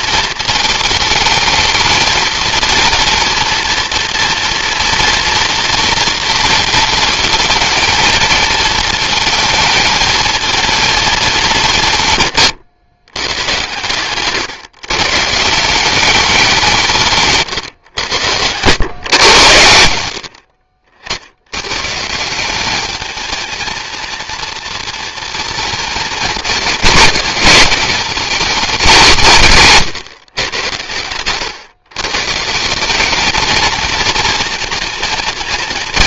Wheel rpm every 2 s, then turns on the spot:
220, 230, 230, 220, 220, 220, 110, 140, 150, 120, 60, 220, 230, 210, 190, 100, 200, 230.
none